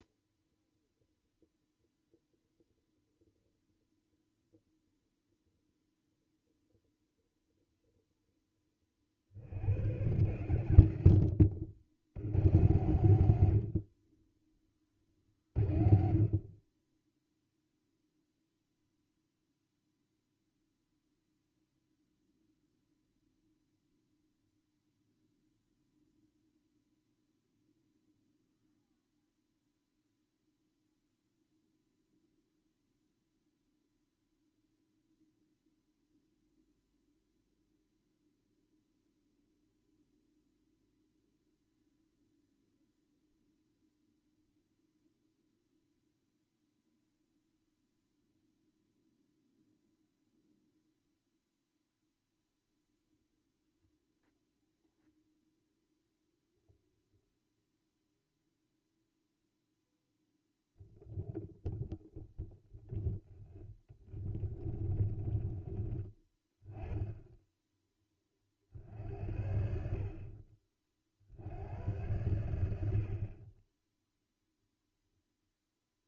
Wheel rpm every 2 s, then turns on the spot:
0, 0, 0, 0, 30, 100, 110, 20, 20, 0, 0, 0, 0, 0, 0, 0, 0, 0, 0, 0, 0, 0, 0, 0, 0, 0, 0, 0, 0, 0, 0, 0, 20, 10, 50, 40, 70, 0.
64-66